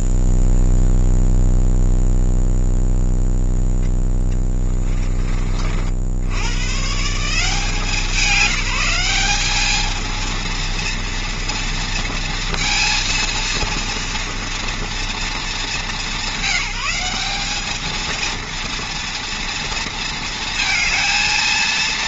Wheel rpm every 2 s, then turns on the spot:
0, 0, 20, 110, 190, 230, 230, 230, 190, 230, 230.
4-6